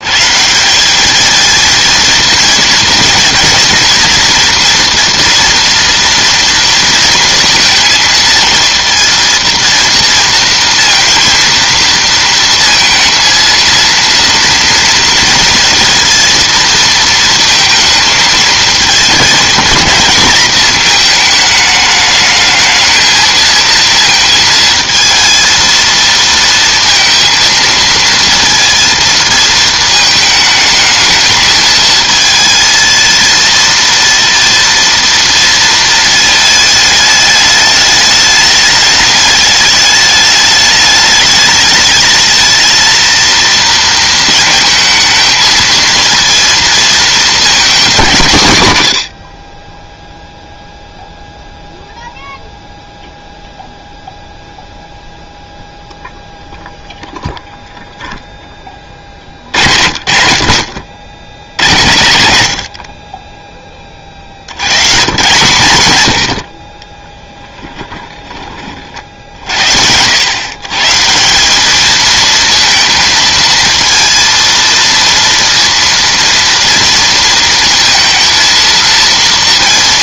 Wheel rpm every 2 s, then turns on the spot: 180, 240, 240, 230, 230, 230, 230, 230, 230, 220, 220, 220, 230, 230, 230, 220, 220, 230, 220, 210, 210, 220, 220, 230, 140, 0, 0, 0, 0, 10, 50, 60, 100, 40, 30, 140, 230, 230, 230, 230.
none